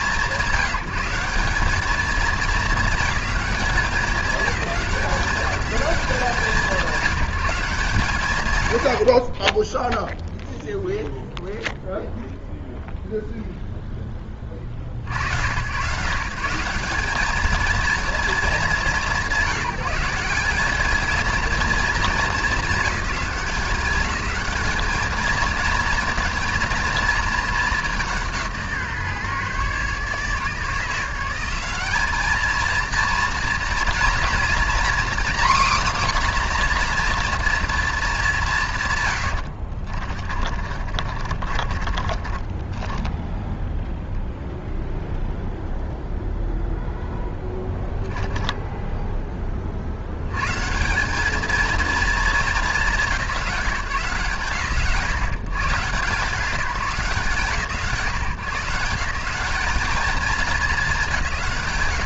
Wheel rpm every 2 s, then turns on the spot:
170, 210, 200, 170, 80, 0, 0, 60, 190, 170, 220, 210, 220, 230, 150, 170, 230, 260, 250, 150, 40, 10, 0, 0, 20, 190, 190, 140, 170, 170, 180.
40-44